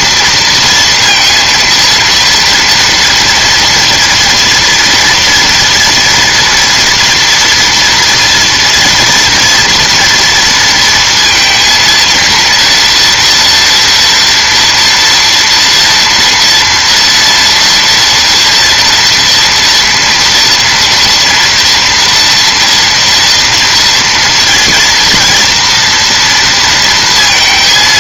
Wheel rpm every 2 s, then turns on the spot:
230, 230, 240, 230, 230, 230, 230, 230, 230, 230, 230, 230, 230, 230.
none